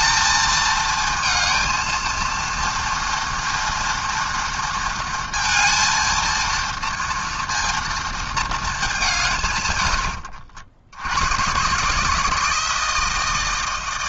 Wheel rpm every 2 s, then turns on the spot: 220, 230, 230, 230, 220, 80, 160.
none